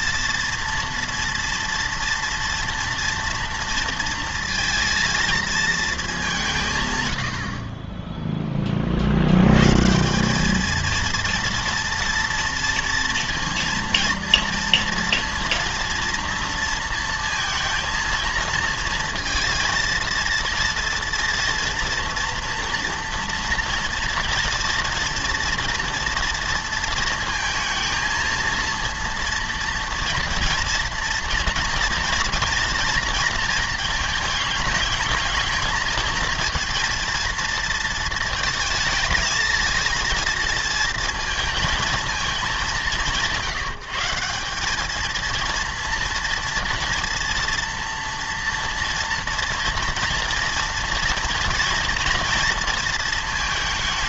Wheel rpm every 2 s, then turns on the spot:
230, 230, 230, 150, 20, 210, 230, 230, 230, 230, 230, 240, 230, 230, 230, 230, 230, 210, 230, 220, 230, 200, 200, 230, 230, 230, 230.
none